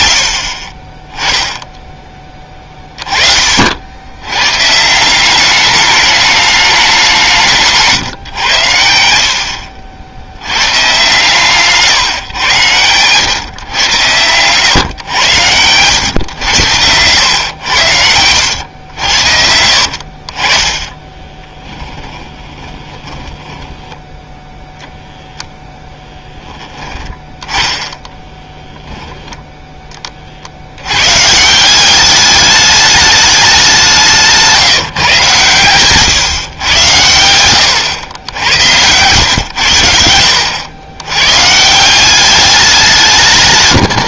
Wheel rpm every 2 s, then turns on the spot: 50, 20, 130, 210, 110, 100, 110, 120, 100, 90, 30, 20, 0, 10, 10, 60, 210, 160, 120, 90, 90, 200.
18-20 22-24